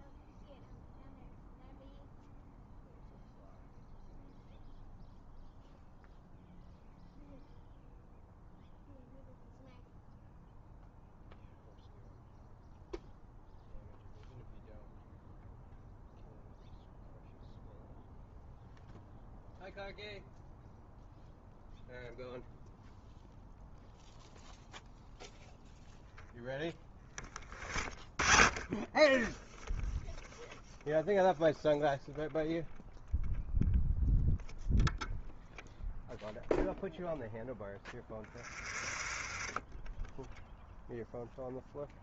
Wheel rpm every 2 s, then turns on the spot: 0, 0, 0, 0, 0, 0, 0, 0, 0, 0, 0, 0, 0, 10, 10, 0, 0, 0, 0, 30, 0.
38-40